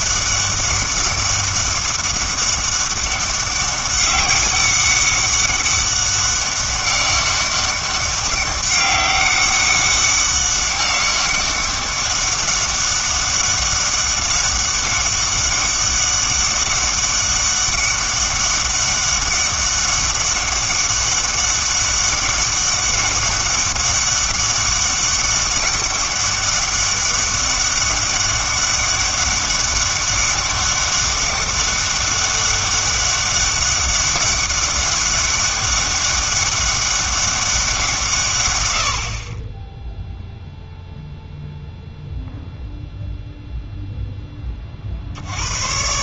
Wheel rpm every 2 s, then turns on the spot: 200, 200, 200, 200, 200, 200, 200, 200, 200, 200, 200, 200, 200, 200, 200, 200, 200, 200, 200, 100, 0, 0, 20.
none